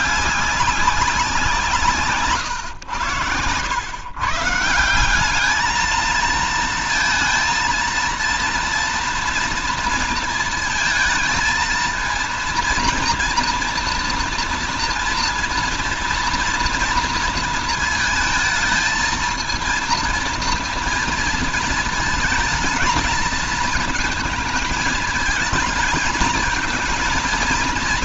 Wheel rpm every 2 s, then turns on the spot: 200, 120, 160, 230, 240, 230, 230, 230, 230, 220, 230, 220, 230, 220.
none